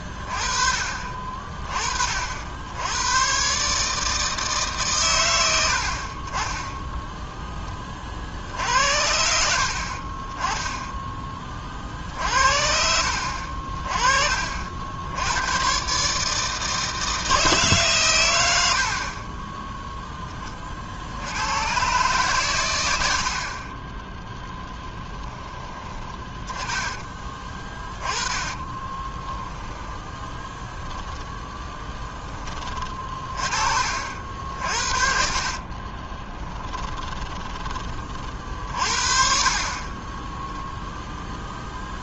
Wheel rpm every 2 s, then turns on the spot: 30, 130, 100, 10, 70, 30, 50, 110, 160, 20, 80, 50, 20, 20, 20, 10, 40, 50, 10, 40, 0.
24-32 34-38